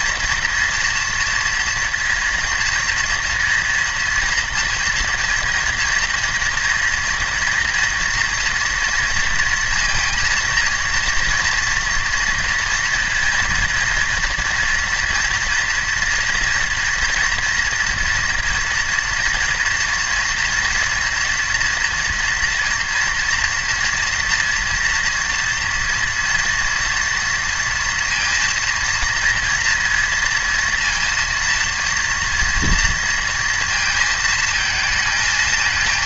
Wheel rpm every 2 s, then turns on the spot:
240, 230, 230, 240, 230, 230, 230, 240, 230, 230, 240, 230, 230, 230, 230, 230, 230, 230.
none